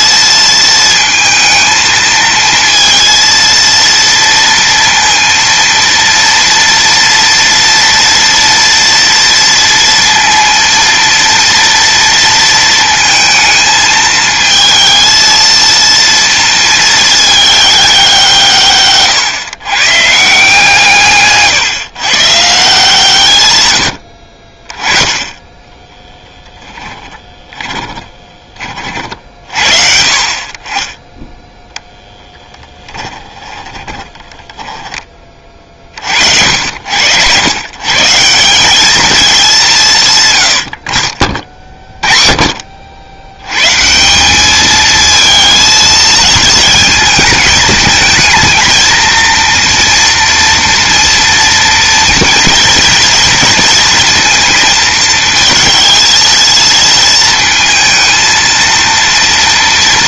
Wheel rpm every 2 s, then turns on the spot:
230, 230, 230, 230, 230, 230, 220, 220, 220, 140, 150, 140, 20, 10, 50, 10, 10, 30, 100, 210, 40, 90, 220, 220, 230, 230, 230, 230, 230, 230.
26-28 32-34